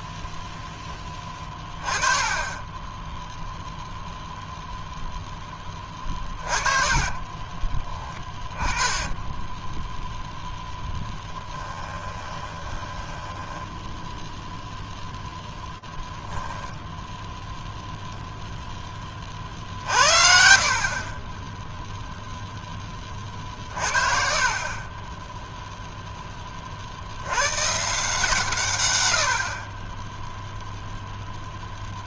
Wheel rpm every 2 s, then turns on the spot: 0, 10, 0, 30, 20, 0, 10, 0, 0, 10, 40, 30, 20, 70, 100, 0.
6-10 12-14